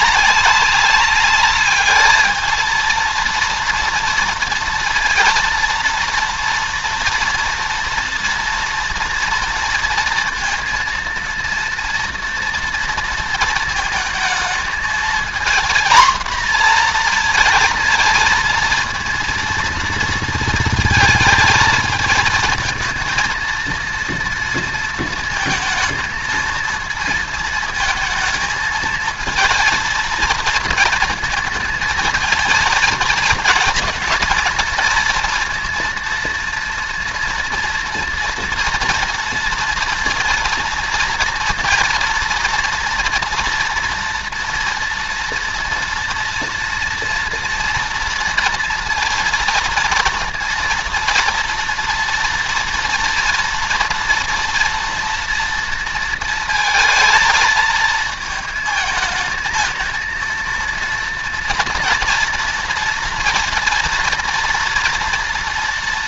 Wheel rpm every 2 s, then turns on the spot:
190, 230, 230, 230, 230, 230, 230, 220, 230, 230, 220, 230, 230, 230, 230, 220, 220, 230, 230, 230, 230, 230, 230, 230, 230, 230, 230, 230, 220, 220, 230, 230, 230.
none